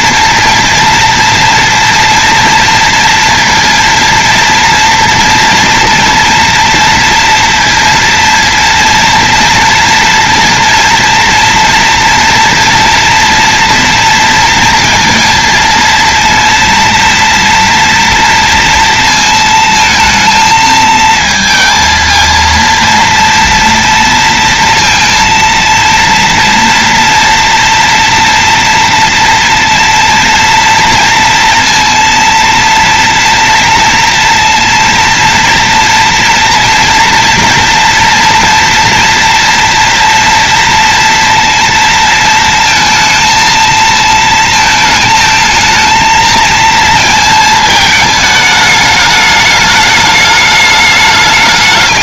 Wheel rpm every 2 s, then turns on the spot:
230, 230, 240, 230, 230, 230, 230, 230, 230, 230, 220, 230, 230, 230, 230, 230, 230, 230, 230, 240, 230, 230, 220, 230, 210, 210.
none